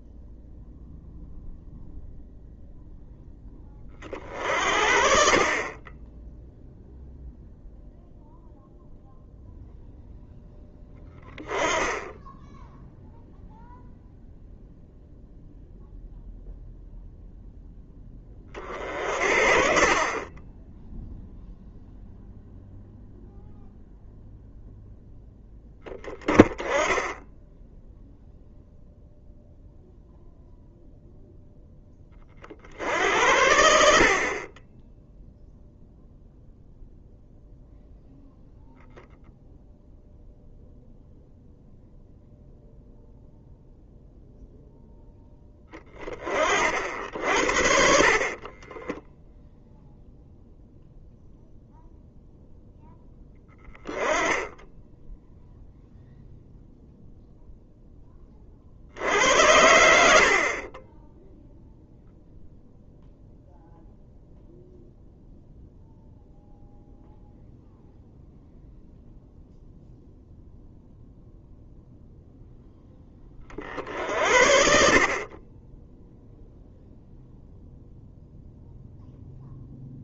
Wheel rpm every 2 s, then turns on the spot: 0, 0, 50, 0, 0, 10, 0, 0, 0, 40, 10, 0, 0, 10, 0, 0, 70, 10, 0, 0, 0, 0, 0, 50, 10, 0, 0, 10, 0, 60, 20, 0, 0, 0, 0, 0, 10, 50, 0, 0.
48-50